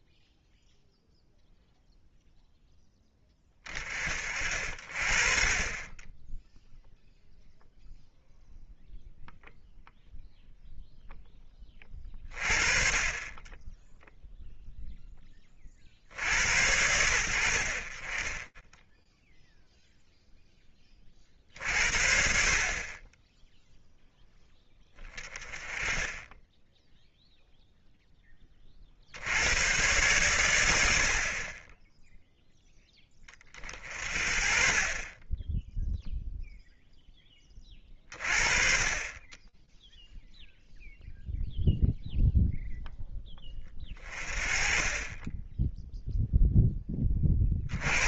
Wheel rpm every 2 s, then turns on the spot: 0, 0, 50, 10, 0, 0, 30, 0, 80, 20, 20, 40, 10, 10, 50, 80, 20, 20, 0, 30, 0, 0, 30, 10.
none